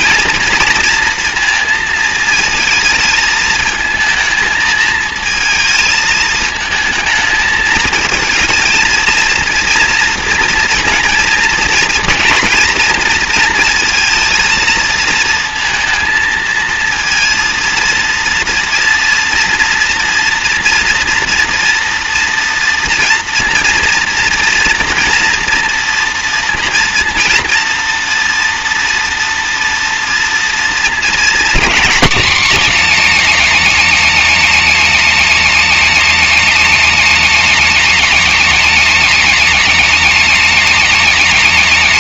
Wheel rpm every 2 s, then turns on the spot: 230, 220, 220, 220, 230, 230, 230, 230, 230, 230, 240, 230, 230, 230, 230, 230, 260, 260, 260, 260, 260.
none